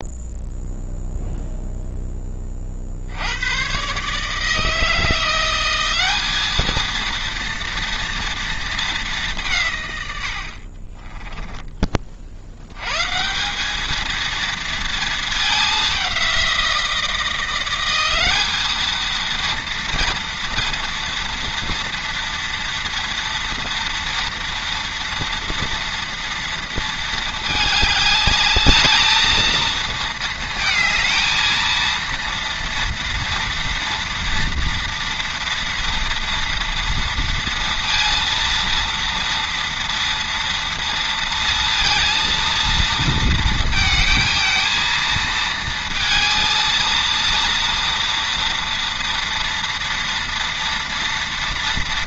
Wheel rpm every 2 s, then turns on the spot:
0, 60, 160, 220, 210, 30, 120, 220, 170, 220, 230, 230, 230, 230, 210, 220, 230, 230, 230, 230, 230, 220, 230, 230, 230, 240.
10-12